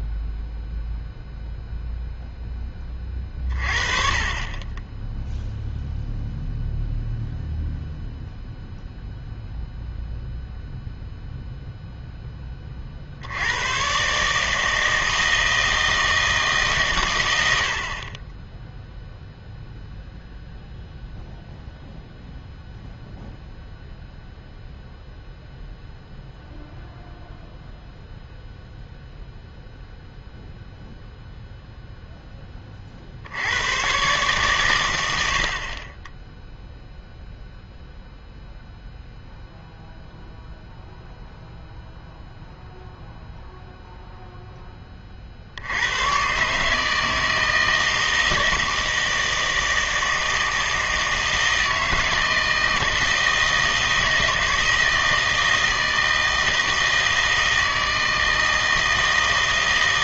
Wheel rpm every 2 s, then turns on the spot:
0, 10, 20, 0, 0, 0, 30, 160, 140, 0, 0, 0, 0, 0, 0, 0, 20, 120, 0, 0, 0, 0, 10, 140, 160, 160, 160, 160, 160, 160.
none